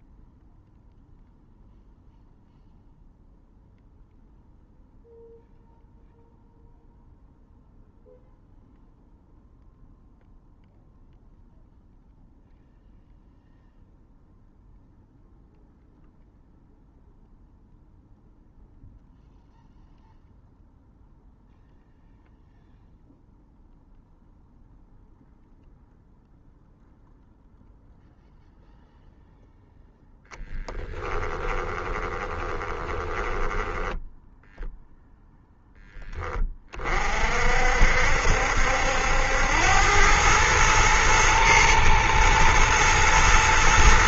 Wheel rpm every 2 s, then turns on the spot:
0, 0, 0, 0, 0, 0, 0, 0, 0, 0, 0, 0, 0, 0, 0, 20, 20, 0, 40, 80, 110, 110.
30-34